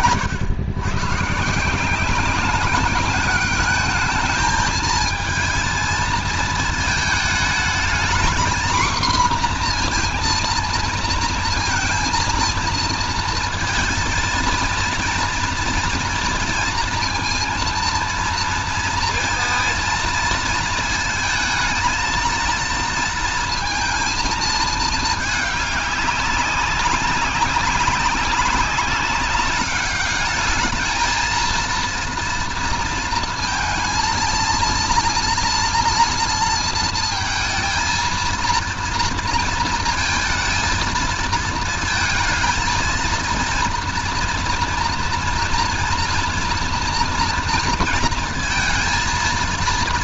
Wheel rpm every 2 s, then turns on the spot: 120, 200, 230, 220, 240, 230, 230, 230, 230, 230, 230, 230, 220, 200, 190, 210, 230, 230, 230, 230, 230, 230, 230, 240, 230.
none